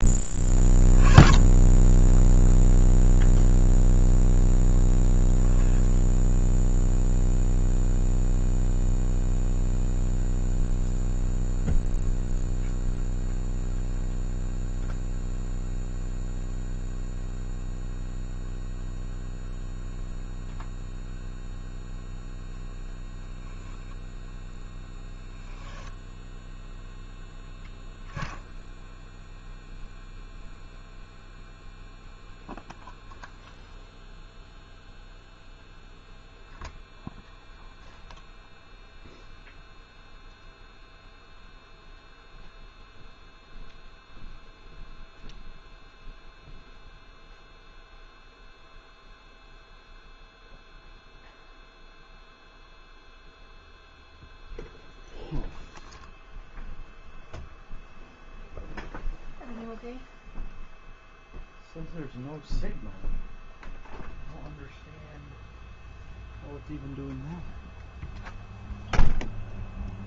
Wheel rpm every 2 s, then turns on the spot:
20, 0, 0, 0, 0, 0, 0, 0, 0, 0, 0, 10, 10, 0, 0, 0, 0, 0, 0, 0, 0, 0, 0, 0, 0, 0, 0, 0, 0, 0, 0, 0, 0, 0, 0.
none